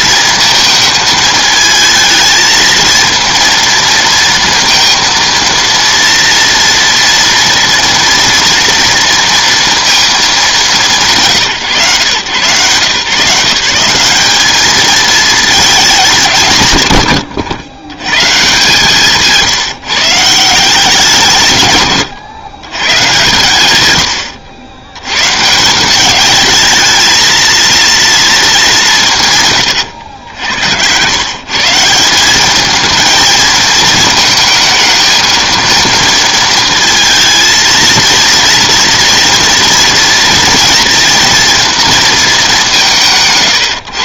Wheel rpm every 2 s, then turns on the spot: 220, 230, 230, 230, 230, 200, 130, 210, 120, 150, 170, 130, 90, 220, 190, 90, 220, 220, 220, 230, 230, 180.
none